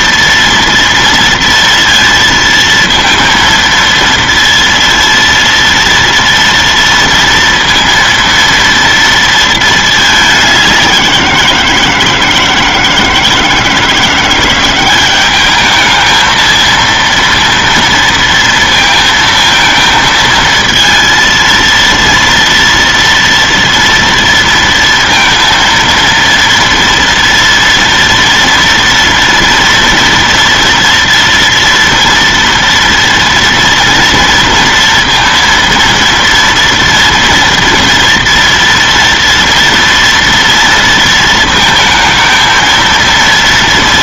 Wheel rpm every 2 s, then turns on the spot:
230, 230, 230, 230, 230, 180, 160, 190, 230, 230, 230, 230, 230, 230, 230, 230, 230, 230, 230, 230, 230, 230.
none